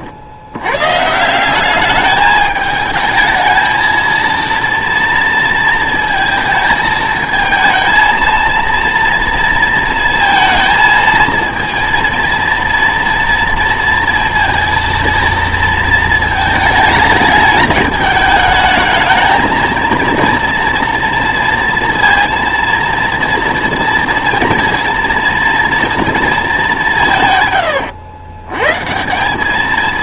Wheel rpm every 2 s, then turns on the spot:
110, 210, 230, 220, 230, 230, 230, 230, 220, 220, 230, 230, 230, 200, 130.
none